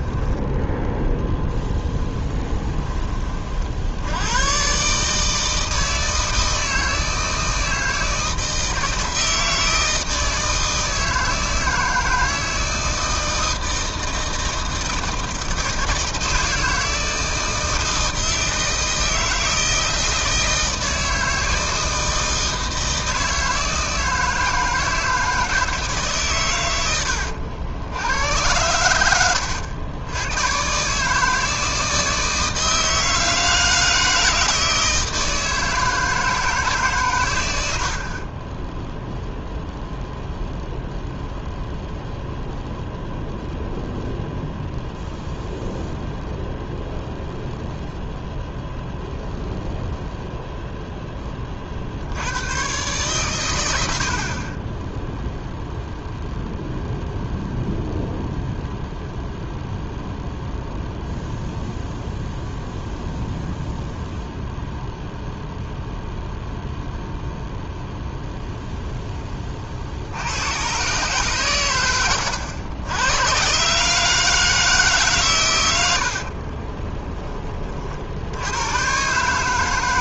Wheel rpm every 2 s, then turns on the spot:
0, 20, 140, 160, 160, 160, 160, 160, 160, 160, 160, 160, 160, 100, 100, 140, 160, 160, 140, 10, 0, 0, 0, 0, 0, 0, 110, 10, 0, 0, 0, 0, 0, 0, 10, 130, 100, 150, 20, 120.
26-28 38-40 54-56 76-78